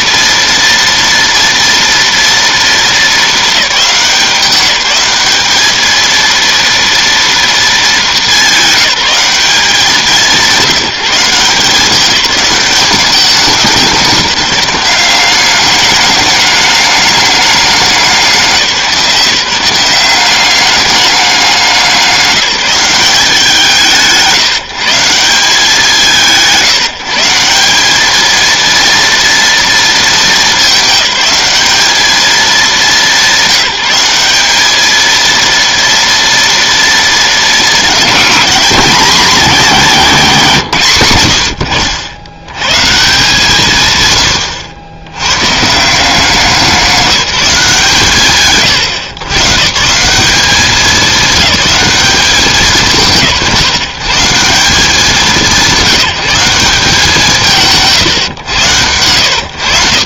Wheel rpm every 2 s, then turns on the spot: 230, 210, 200, 230, 200, 180, 200, 190, 210, 170, 200, 200, 170, 160, 230, 210, 190, 220, 220, 210, 120, 170, 100, 190, 140, 210, 160, 170, 170, 110.
none